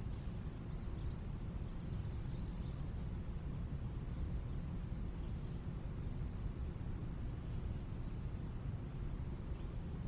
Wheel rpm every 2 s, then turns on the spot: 0, 0, 0, 0, 0.
none